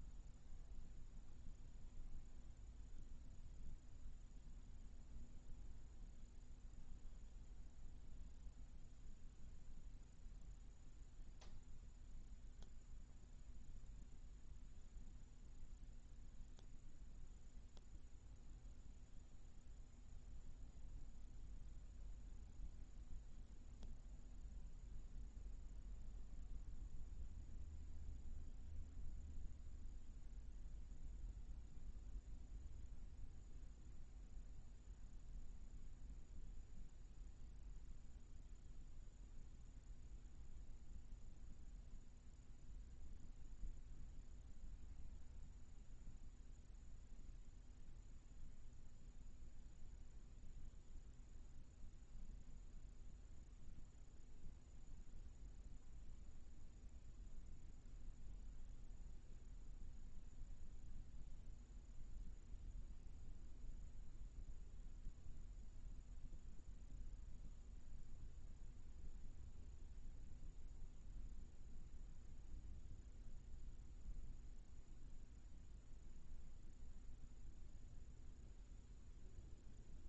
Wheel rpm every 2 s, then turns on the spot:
0, 0, 0, 0, 0, 0, 0, 0, 0, 0, 0, 0, 0, 0, 0, 0, 0, 0, 0, 0, 0, 0, 0, 0, 0, 0, 0, 0, 0, 0, 0, 0, 0, 0, 0, 0, 0, 0, 0, 0.
none